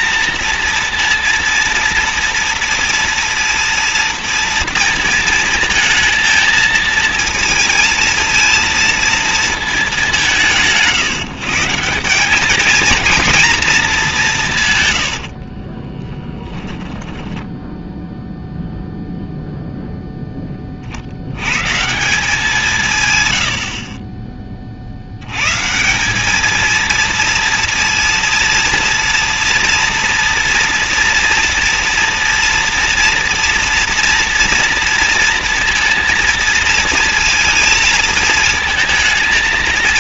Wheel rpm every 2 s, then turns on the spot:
230, 230, 230, 220, 230, 170, 220, 160, 10, 0, 30, 170, 40, 220, 230, 230, 240, 230, 230, 220.
16-18